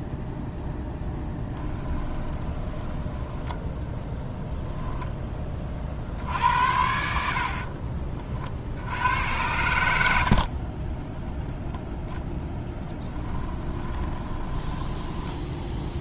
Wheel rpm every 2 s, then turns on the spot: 0, 10, 10, 70, 70, 30, 20, 10.
2-4 10-16